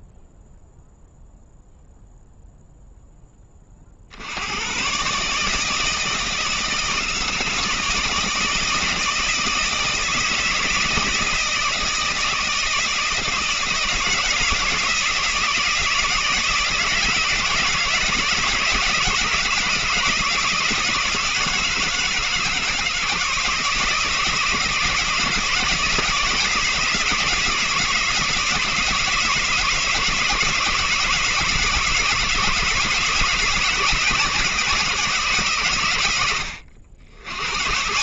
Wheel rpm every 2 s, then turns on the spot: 0, 0, 100, 160, 160, 160, 160, 160, 160, 170, 160, 170, 160, 170, 160, 160, 160, 170, 80.
none